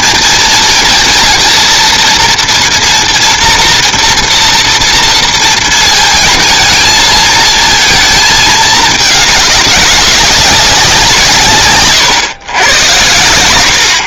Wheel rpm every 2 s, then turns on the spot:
230, 230, 230, 220, 220, 180, 90.
none